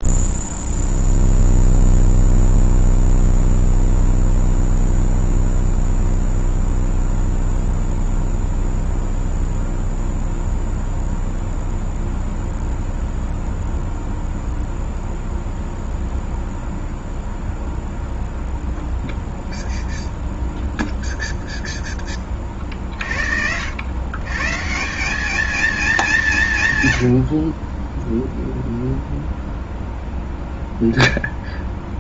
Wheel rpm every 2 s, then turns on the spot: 0, 0, 0, 0, 0, 0, 0, 0, 0, 0, 0, 30, 140, 120, 0, 0.
none